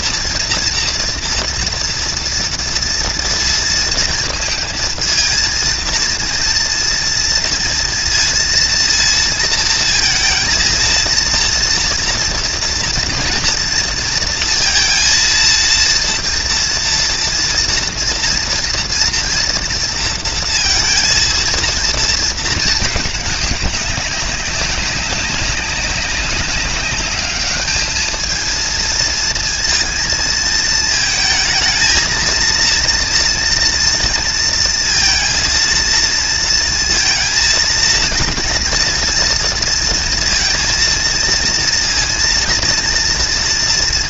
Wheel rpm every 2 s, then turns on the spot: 230, 230, 230, 230, 230, 220, 230, 230, 230, 230, 230, 220, 200, 200, 220, 230, 230, 230, 230, 230, 230, 230.
none